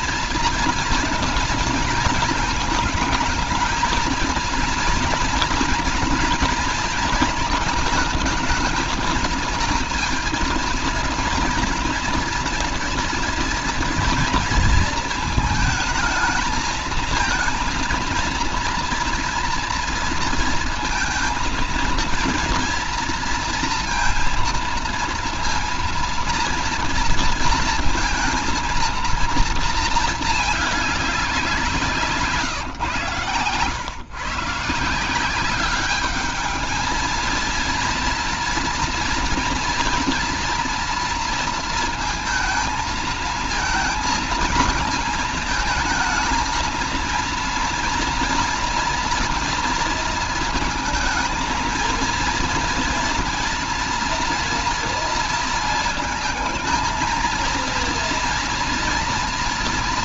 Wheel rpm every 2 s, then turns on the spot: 230, 210, 230, 230, 220, 240, 230, 220, 220, 230, 230, 230, 230, 230, 230, 200, 120, 180, 220, 240, 230, 220, 220, 230, 230, 220, 230, 230, 230, 240.
none